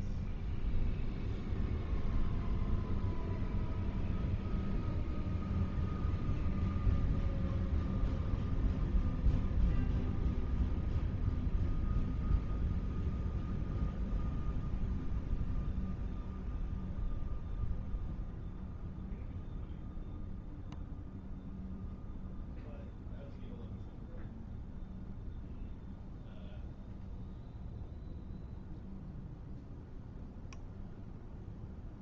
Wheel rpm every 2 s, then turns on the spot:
0, 0, 0, 0, 0, 0, 0, 0, 0, 0, 0, 0, 0, 0, 0, 0.
none